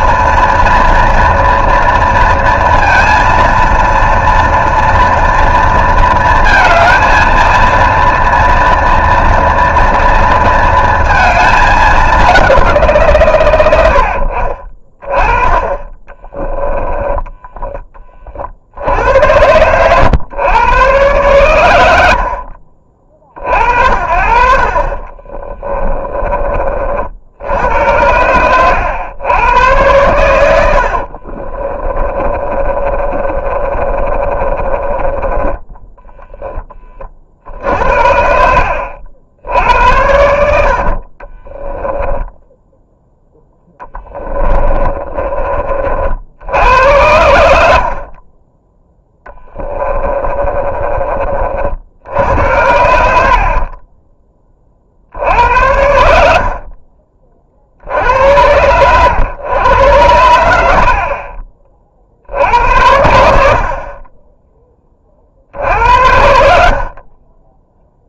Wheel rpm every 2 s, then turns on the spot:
240, 230, 240, 230, 230, 230, 170, 30, 10, 80, 120, 60, 40, 40, 110, 60, 30, 30, 20, 70, 50, 10, 20, 80, 10, 30, 70, 40, 40, 80, 70, 70, 20, 50.
16-18 24-26 30-36 44-46